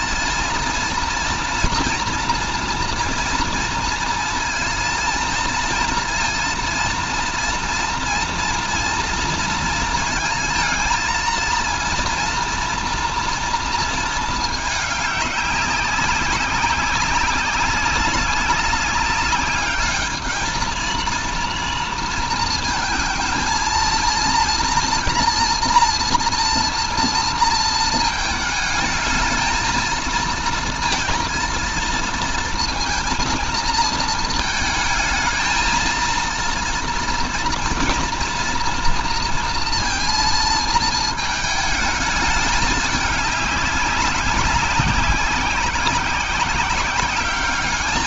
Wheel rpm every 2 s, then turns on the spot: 220, 230, 230, 230, 230, 230, 230, 210, 190, 190, 230, 230, 230, 240, 220, 220, 230, 220, 230, 230, 220, 210, 190, 190.
none